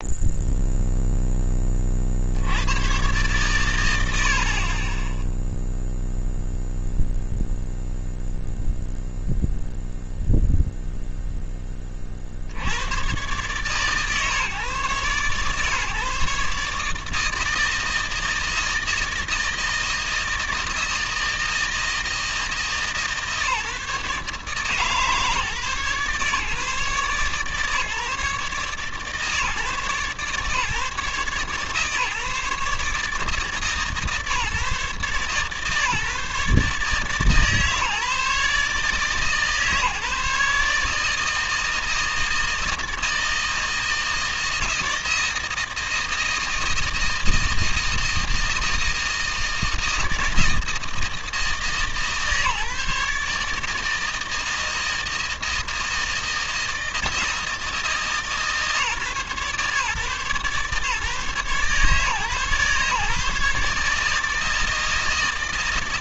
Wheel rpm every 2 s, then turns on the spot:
0, 90, 40, 0, 0, 0, 80, 140, 150, 160, 160, 160, 150, 140, 130, 140, 150, 150, 150, 150, 150, 160, 160, 160, 160, 160, 150, 160, 160, 150, 140, 140, 160.
none